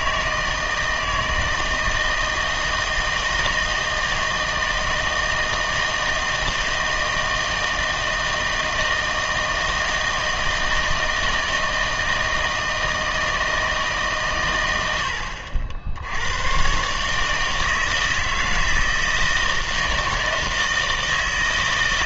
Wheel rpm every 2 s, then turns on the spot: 160, 160, 160, 160, 160, 160, 160, 100, 120, 160, 160.
none